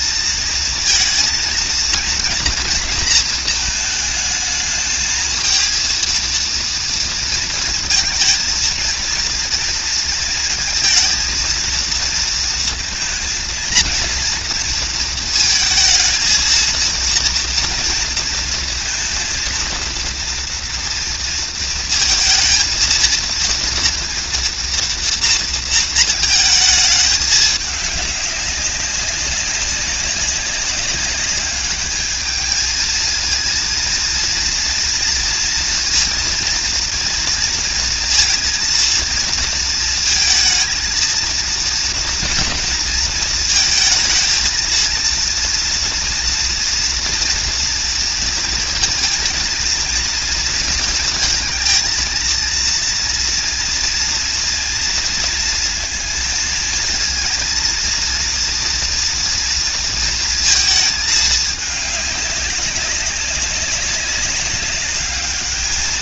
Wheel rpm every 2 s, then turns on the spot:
230, 230, 220, 230, 220, 220, 220, 230, 230, 230, 230, 230, 230, 220, 200, 200, 220, 230, 230, 230, 220, 230, 230, 230, 230, 230, 230, 230, 230, 230, 220, 200, 200.
none